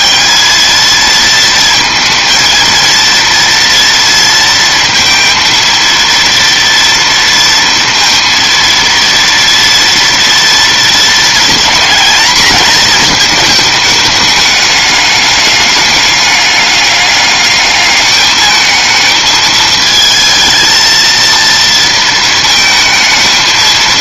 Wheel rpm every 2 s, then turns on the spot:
220, 230, 230, 230, 230, 230, 220, 200, 200, 220, 230, 220.
none